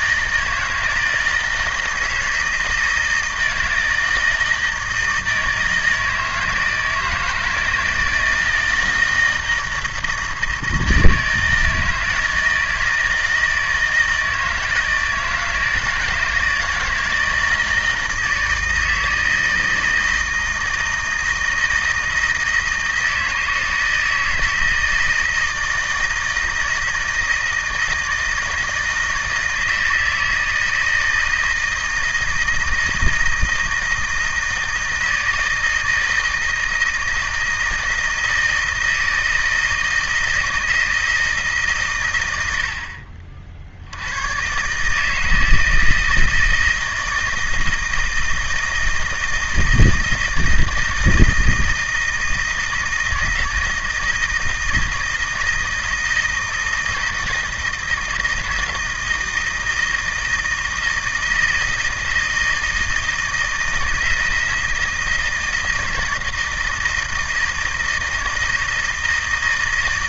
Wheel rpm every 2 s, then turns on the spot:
160, 160, 160, 160, 160, 160, 160, 160, 160, 160, 160, 160, 160, 160, 160, 160, 160, 160, 160, 160, 160, 60, 140, 160, 160, 160, 160, 160, 160, 160, 160, 160, 160, 160, 160.
none